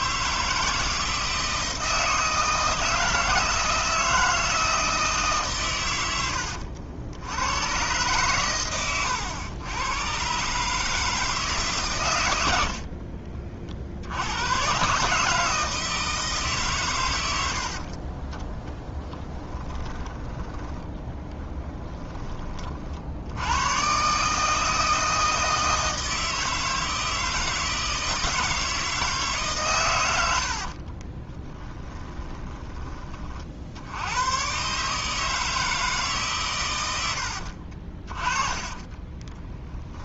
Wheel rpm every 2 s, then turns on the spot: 160, 160, 160, 80, 110, 150, 50, 140, 130, 20, 10, 50, 160, 160, 160, 40, 20, 140, 100, 20.
12-14 18-22 30-32 38-40